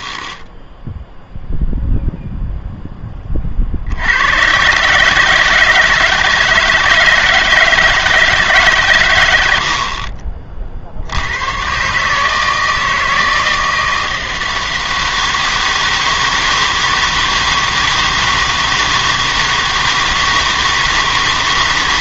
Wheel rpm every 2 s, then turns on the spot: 10, 0, 130, 160, 150, 50, 160, 160, 160, 160, 160.
0-2